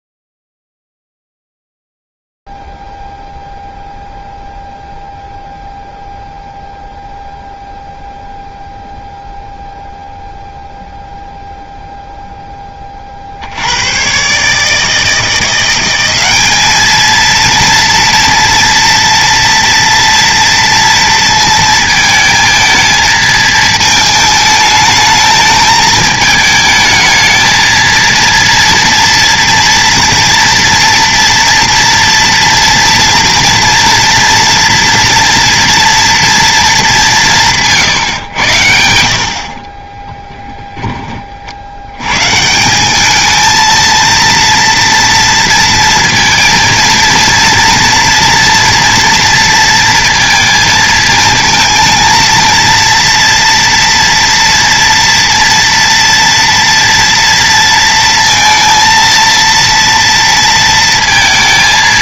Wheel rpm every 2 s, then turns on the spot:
0, 0, 0, 0, 0, 0, 20, 150, 210, 230, 230, 220, 210, 220, 230, 230, 230, 230, 220, 100, 20, 170, 230, 230, 230, 230, 230, 230, 230, 230, 230.
none